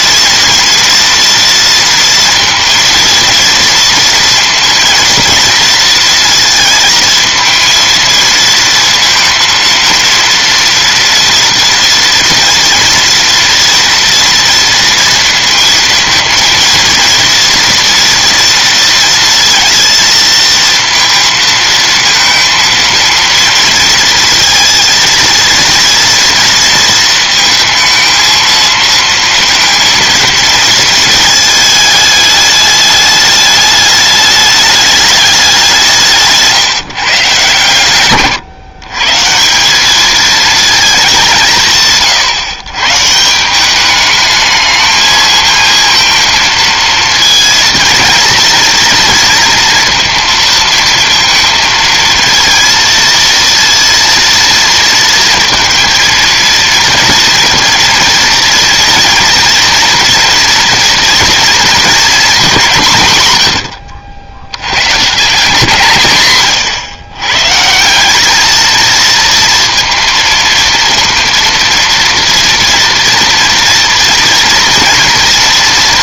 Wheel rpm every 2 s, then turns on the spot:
230, 230, 230, 230, 230, 230, 230, 230, 230, 230, 230, 230, 230, 230, 220, 230, 210, 210, 150, 130, 220, 130, 210, 230, 230, 230, 230, 230, 230, 230, 230, 190, 90, 130, 210, 230, 230, 230.
none